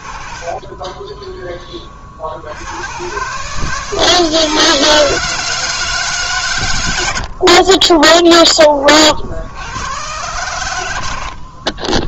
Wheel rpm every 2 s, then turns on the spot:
20, 120, 160, 90, 40, 90.
0-2